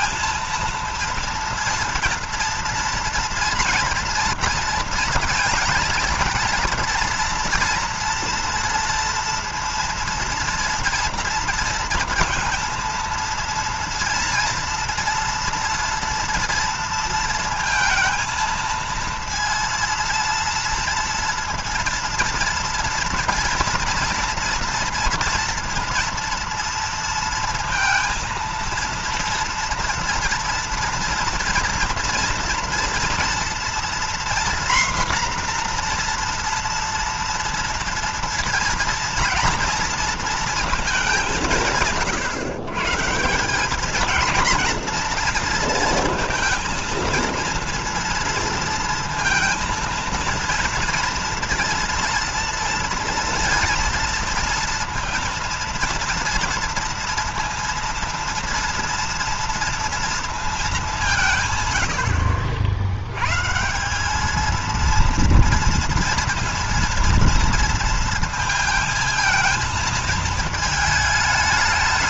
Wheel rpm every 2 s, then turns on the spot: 230, 230, 230, 230, 230, 230, 230, 230, 230, 230, 230, 230, 230, 230, 230, 230, 230, 240, 230, 230, 220, 140, 230, 230, 230, 230, 230, 230, 230, 230, 210, 70, 230, 230, 230, 220.
none